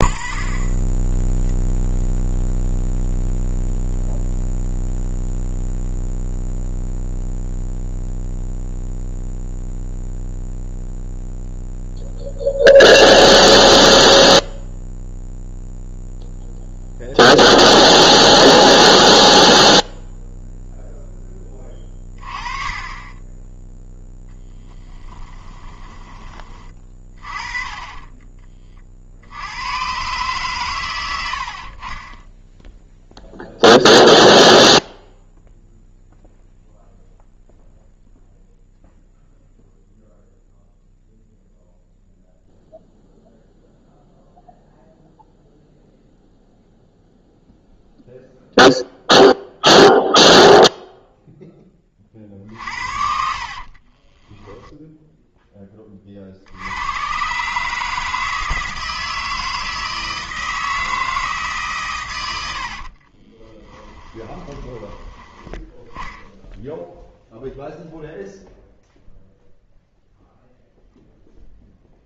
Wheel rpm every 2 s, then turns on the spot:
20, 0, 0, 0, 0, 0, 0, 0, 0, 0, 0, 20, 10, 30, 30, 120, 0, 0, 0, 0, 0, 0, 0, 0, 0, 0, 50, 10, 90, 160, 160, 80, 20, 0, 0, 0.
22-28 54-56 62-66